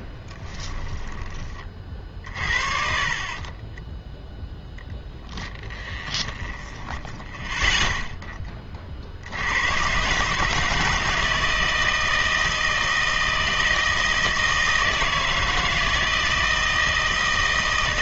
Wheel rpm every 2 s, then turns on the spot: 10, 40, 0, 10, 40, 160, 160, 160, 160.
0-4 6-8